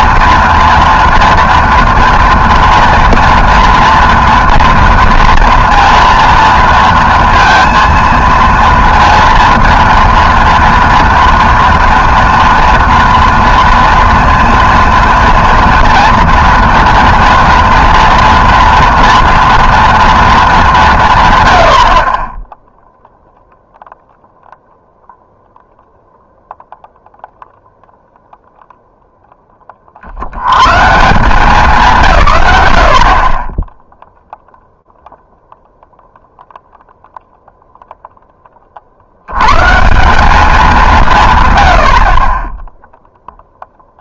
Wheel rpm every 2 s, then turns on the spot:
230, 230, 230, 230, 230, 240, 230, 230, 230, 230, 190, 0, 0, 0, 0, 140, 70, 0, 0, 50, 190, 0.
none